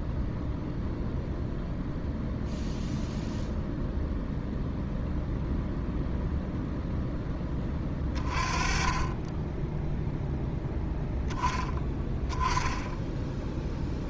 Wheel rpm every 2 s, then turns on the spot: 0, 0, 0, 0, 30, 0, 10.
none